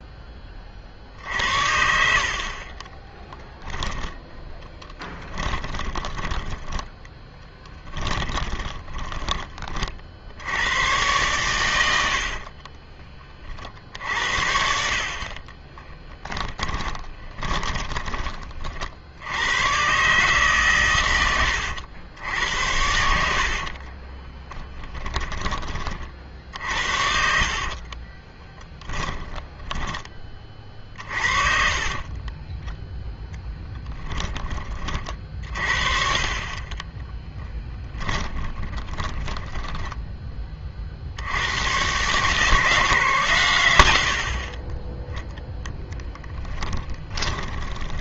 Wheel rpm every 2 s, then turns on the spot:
40, 30, 10, 10, 20, 100, 30, 60, 20, 50, 120, 80, 20, 70, 30, 40, 10, 40, 40, 20, 40, 160, 20, 20.
2-10 12-14 16-18 22-32 36-40 46-48